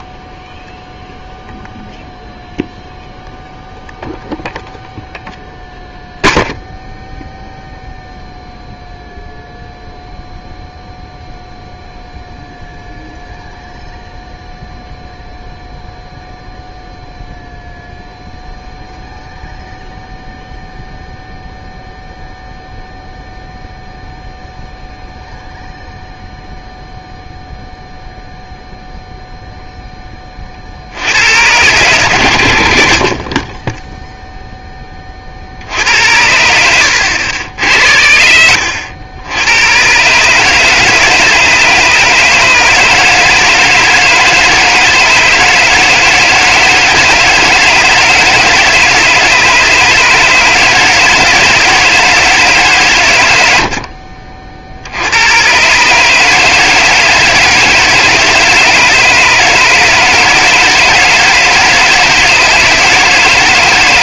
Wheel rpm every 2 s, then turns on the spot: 0, 0, 0, 0, 0, 0, 0, 0, 0, 0, 0, 0, 0, 0, 0, 50, 80, 10, 80, 80, 150, 150, 160, 160, 160, 160, 150, 60, 160, 160, 160, 160.
36-38